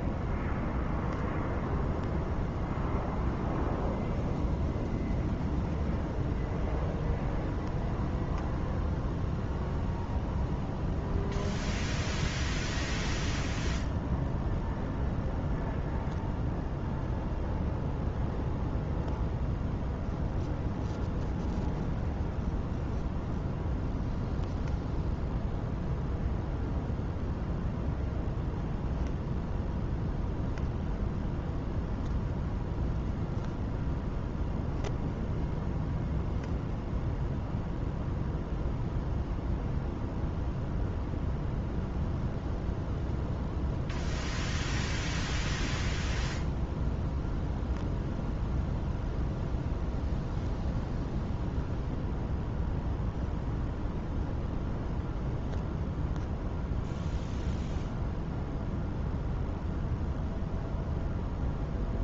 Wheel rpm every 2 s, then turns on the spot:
0, 0, 0, 0, 0, 0, 0, 0, 0, 0, 0, 0, 0, 0, 0, 0, 0, 0, 0, 0, 0, 0, 0, 0, 0, 0, 0, 0, 0, 0, 0.
none